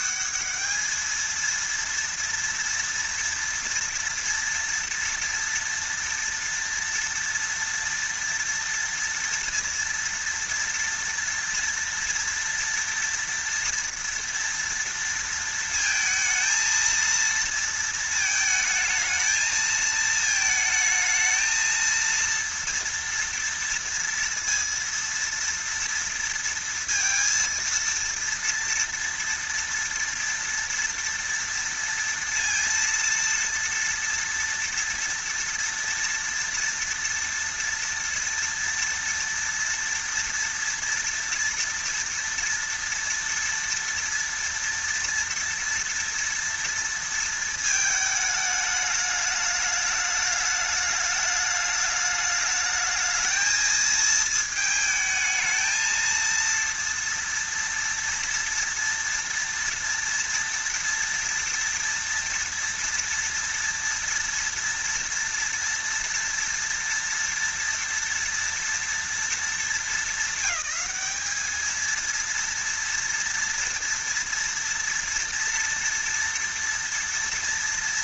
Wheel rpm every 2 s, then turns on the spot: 220, 230, 230, 230, 230, 230, 230, 230, 230, 220, 220, 230, 230, 230, 230, 230, 230, 230, 230, 230, 230, 230, 230, 230, 210, 210, 220, 220, 230, 230, 230, 230, 230, 230, 230, 210, 230, 230, 230.
none